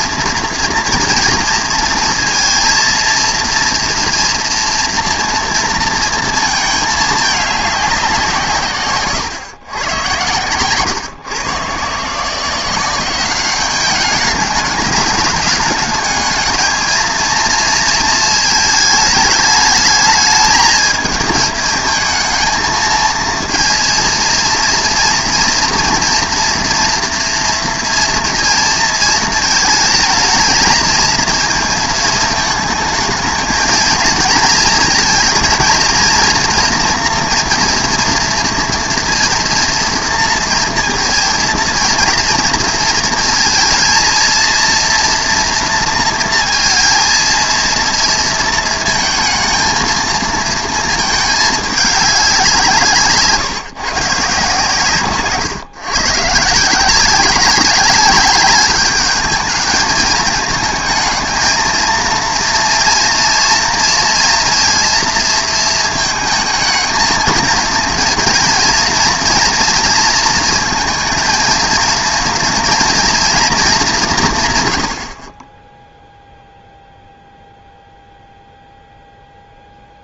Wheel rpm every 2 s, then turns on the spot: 230, 230, 230, 220, 150, 120, 180, 210, 220, 220, 220, 220, 230, 230, 230, 220, 220, 230, 240, 230, 230, 230, 230, 230, 230, 230, 180, 150, 150, 200, 220, 230, 230, 220, 230, 230, 240, 130, 0, 0.
none